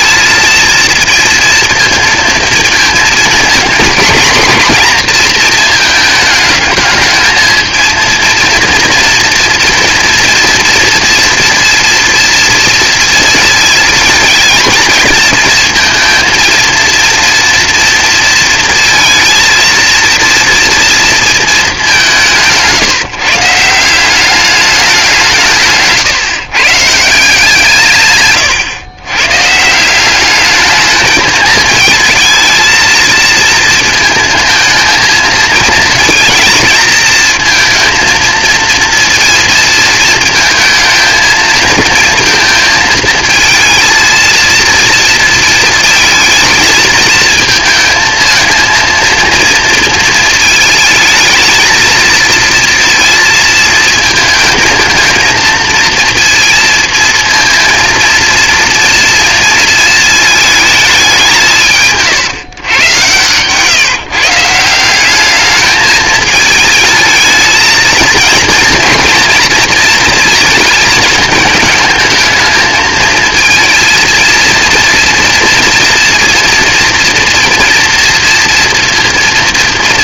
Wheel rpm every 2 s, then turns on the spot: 220, 220, 230, 220, 230, 230, 230, 220, 230, 230, 230, 150, 200, 140, 120, 210, 220, 230, 220, 230, 230, 230, 230, 220, 220, 220, 230, 220, 230, 230, 210, 120, 170, 220, 230, 220, 220, 230, 230, 230.
none